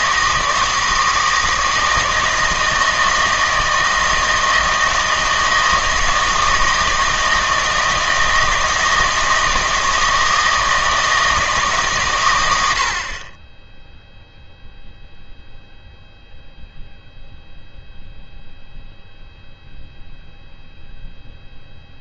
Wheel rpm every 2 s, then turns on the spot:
160, 160, 160, 160, 160, 160, 80, 0, 0, 0, 0.
none